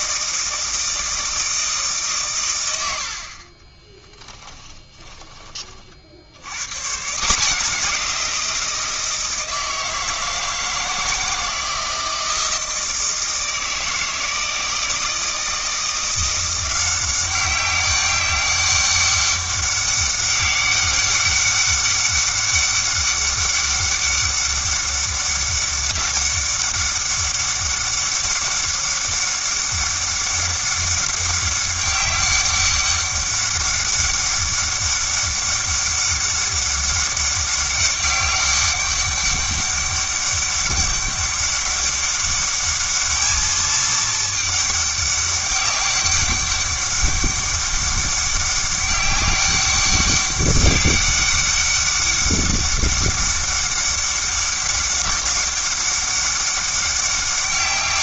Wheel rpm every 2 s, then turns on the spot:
160, 100, 10, 130, 170, 160, 160, 160, 180, 200, 200, 200, 200, 200, 200, 200, 200, 200, 200, 200, 200, 210, 210, 200, 200, 200, 200, 200, 200.
4-6